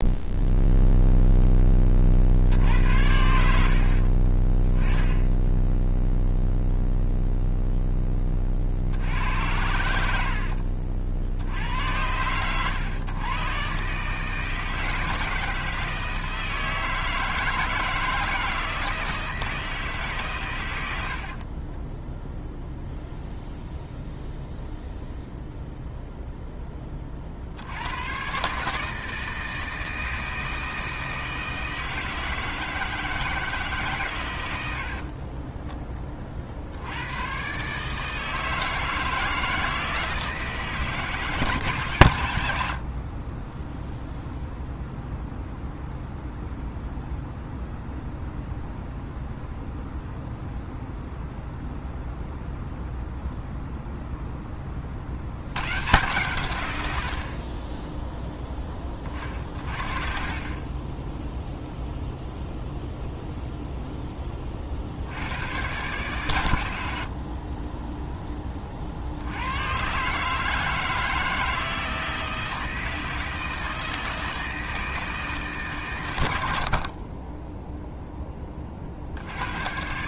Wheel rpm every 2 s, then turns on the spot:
0, 70, 30, 0, 40, 60, 110, 160, 160, 160, 110, 0, 0, 10, 140, 160, 160, 100, 60, 160, 160, 80, 0, 0, 0, 0, 0, 20, 100, 10, 30, 0, 30, 110, 30, 160, 160, 160, 70, 30.
10-12